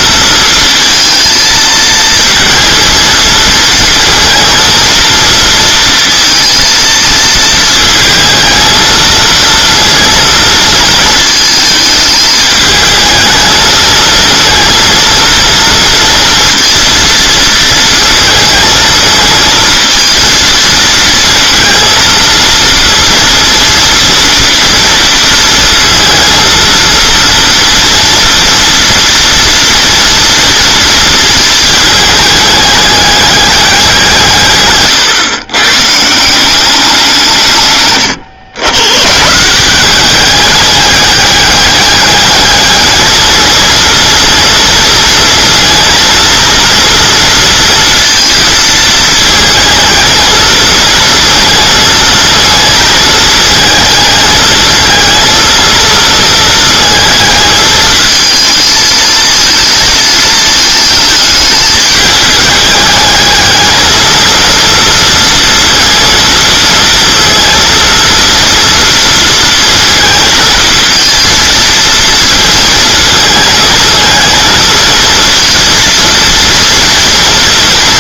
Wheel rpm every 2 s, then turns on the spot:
230, 230, 230, 220, 220, 230, 220, 230, 230, 220, 230, 230, 230, 230, 230, 230, 210, 130, 190, 110, 200, 210, 230, 230, 220, 220, 230, 220, 220, 220, 220, 210, 230, 230, 230, 230, 230, 230, 230.
none